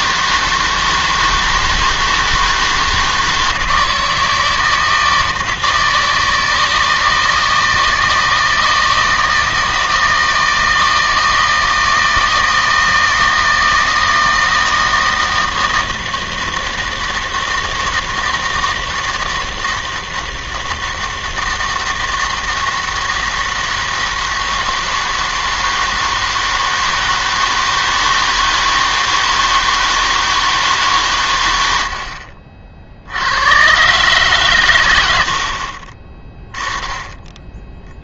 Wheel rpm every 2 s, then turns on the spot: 160, 160, 160, 160, 160, 160, 160, 160, 160, 160, 160, 160, 160, 160, 160, 160, 60, 130, 10.
none